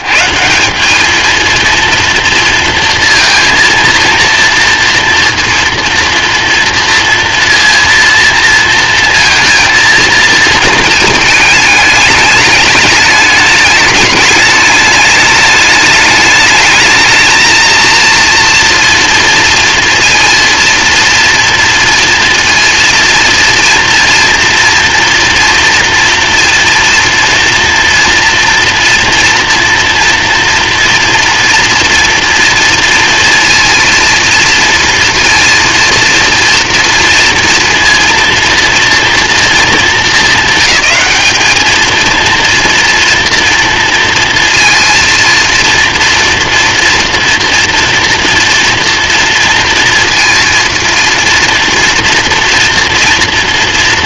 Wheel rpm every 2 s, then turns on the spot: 160, 230, 230, 230, 230, 230, 220, 210, 220, 230, 230, 230, 230, 240, 230, 230, 230, 230, 230, 230, 220, 230, 230, 230, 230, 230, 230.
none